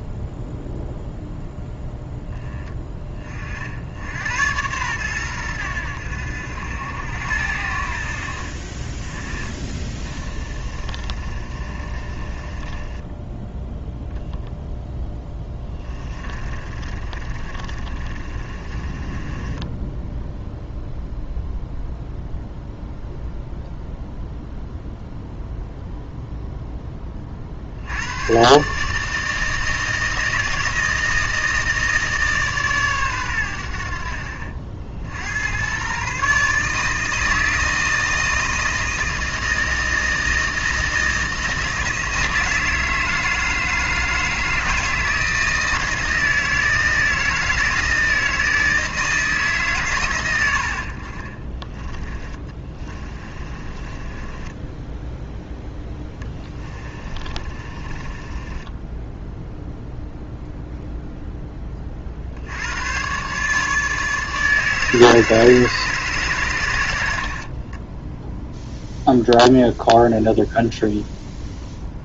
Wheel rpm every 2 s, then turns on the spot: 0, 20, 110, 80, 30, 30, 20, 0, 30, 30, 0, 0, 0, 10, 140, 160, 130, 70, 160, 160, 160, 160, 160, 160, 160, 70, 20, 10, 20, 10, 0, 90, 160, 100, 0, 0.
10-14 16-20 50-60